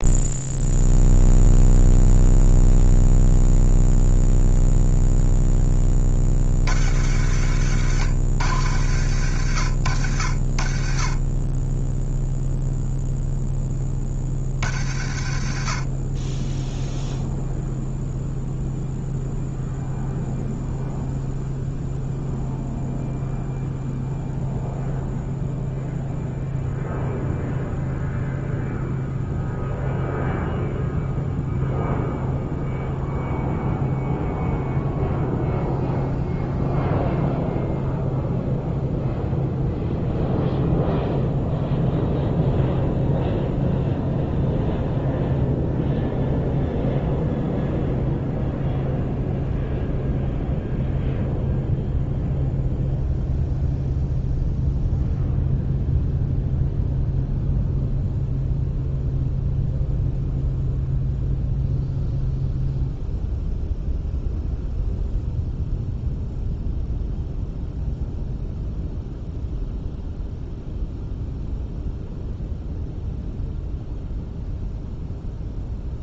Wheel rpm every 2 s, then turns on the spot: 0, 0, 0, 70, 70, 20, 0, 50, 0, 0, 0, 0, 0, 0, 0, 0, 0, 0, 0, 0, 0, 0, 0, 0, 0, 0, 0, 0, 0, 0, 0, 0, 0, 0, 0, 0, 0, 0.
none